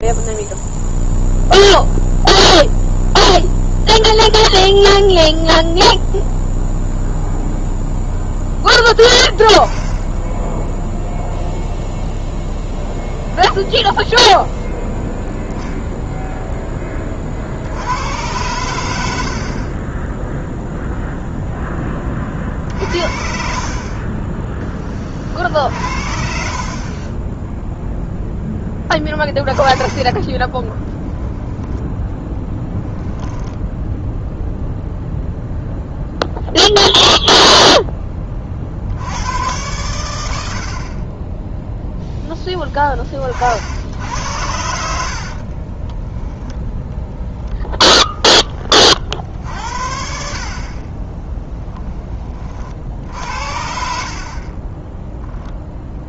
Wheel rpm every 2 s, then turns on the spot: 0, 0, 0, 0, 10, 0, 0, 0, 10, 90, 0, 60, 20, 30, 20, 10, 10, 0, 0, 70, 60, 20, 70, 20, 40, 30, 50, 10.
28-32 44-46 54-56